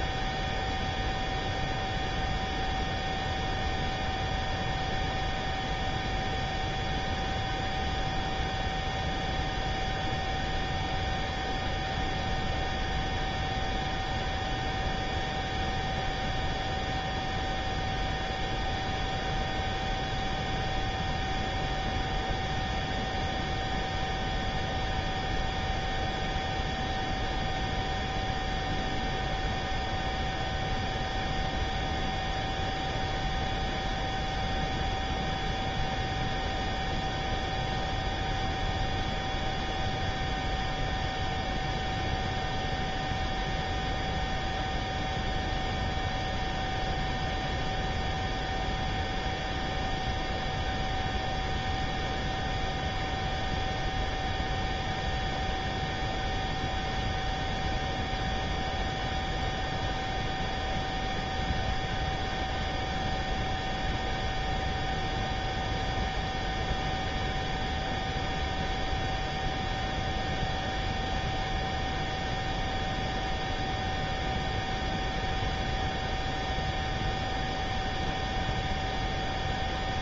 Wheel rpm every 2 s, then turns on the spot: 0, 0, 0, 0, 0, 0, 0, 0, 0, 0, 0, 0, 0, 0, 0, 0, 0, 0, 0, 0, 0, 0, 0, 0, 0, 0, 0, 0, 0, 0, 0, 0, 0, 0, 0, 0, 0, 0, 0, 0.
none